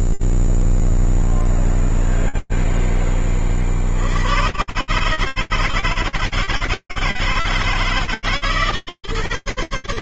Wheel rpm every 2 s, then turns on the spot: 0, 0, 10, 130, 160.
none